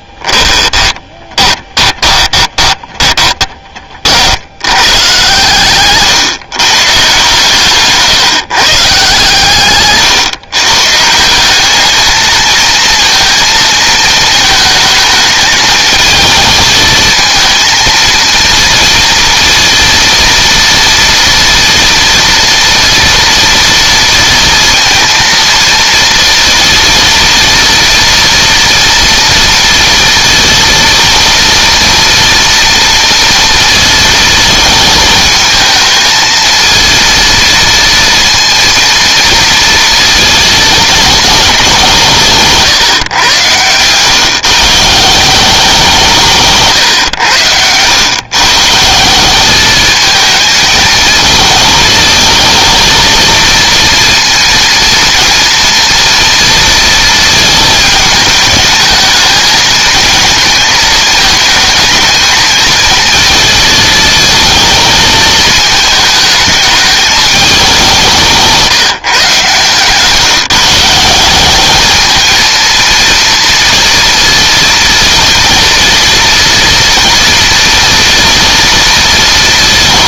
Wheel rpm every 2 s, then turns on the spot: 10, 20, 120, 140, 140, 150, 230, 220, 220, 230, 230, 230, 230, 230, 240, 240, 230, 220, 230, 230, 220, 140, 150, 130, 160, 220, 230, 230, 230, 220, 220, 230, 220, 210, 160, 170, 230, 230, 230, 230.
0-4